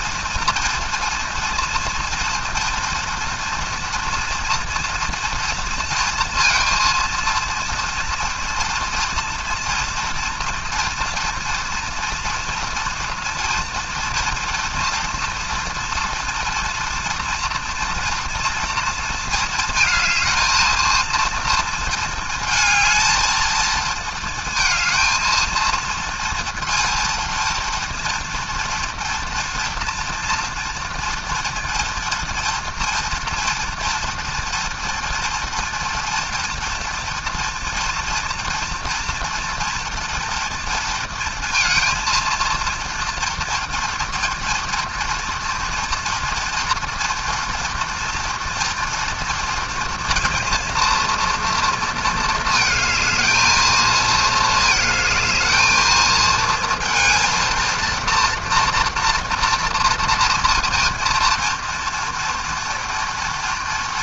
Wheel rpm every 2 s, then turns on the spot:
230, 230, 230, 230, 240, 230, 240, 240, 230, 220, 230, 220, 220, 230, 230, 230, 230, 230, 230, 230, 230, 230, 230, 230, 230, 230, 220, 220, 230, 230, 230, 230.
none